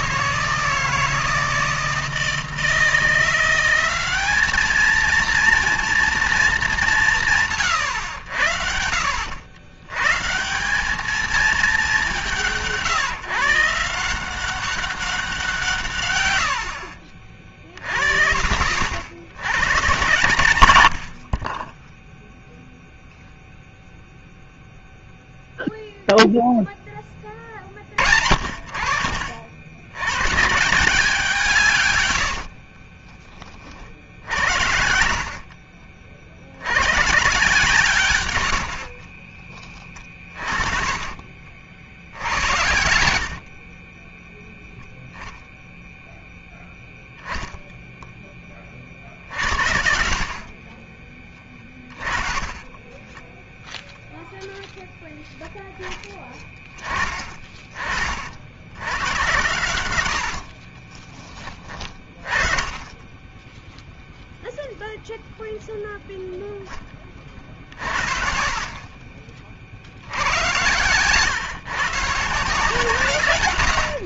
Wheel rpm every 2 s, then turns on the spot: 160, 160, 210, 210, 70, 170, 170, 190, 100, 60, 120, 0, 0, 0, 60, 150, 50, 60, 80, 90, 40, 80, 0, 0, 20, 40, 30, 0, 20, 70, 60, 20, 0, 10, 50, 100, 150.
32-36 38-42 52-54 60-62